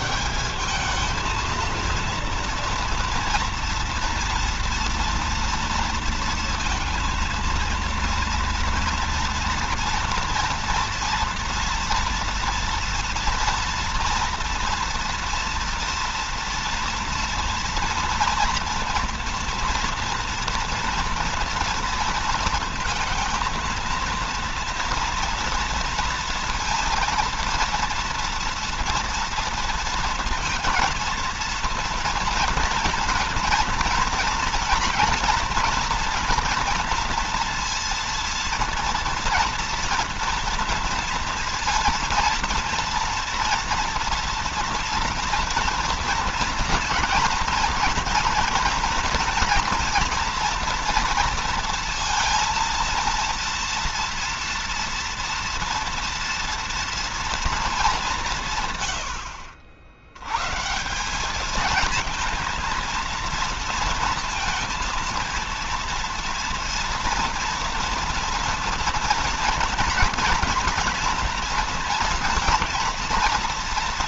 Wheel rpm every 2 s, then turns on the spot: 210, 230, 240, 230, 230, 230, 240, 240, 230, 230, 230, 230, 230, 230, 230, 230, 230, 230, 230, 230, 240, 230, 240, 240, 230, 230, 230, 230, 240, 130, 160, 230, 230, 240, 230, 230, 230.
none